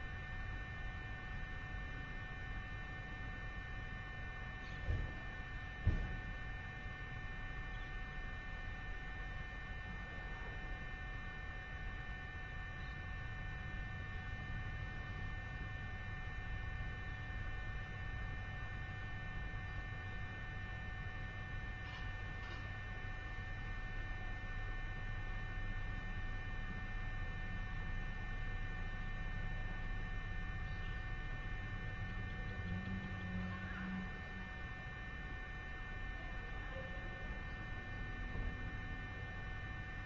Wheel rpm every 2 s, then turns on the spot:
0, 0, 0, 0, 0, 0, 0, 0, 0, 0, 0, 0, 0, 0, 0, 0, 0, 0, 0, 0.
none